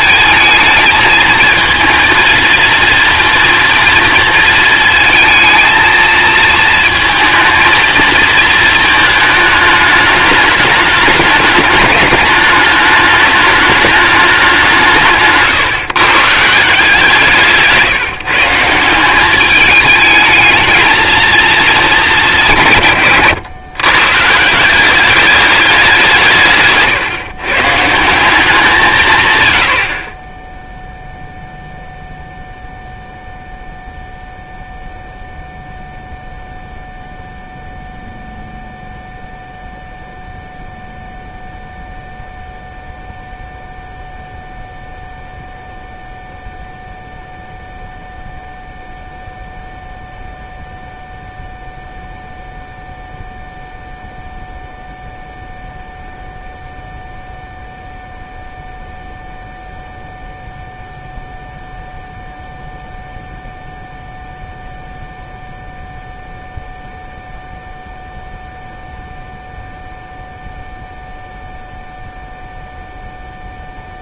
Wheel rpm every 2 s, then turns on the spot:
220, 230, 230, 220, 220, 210, 210, 180, 170, 170, 220, 160, 170, 140, 180, 0, 0, 0, 0, 0, 0, 0, 0, 0, 0, 0, 0, 0, 0, 0, 0, 0, 0, 0, 0, 0, 0.
none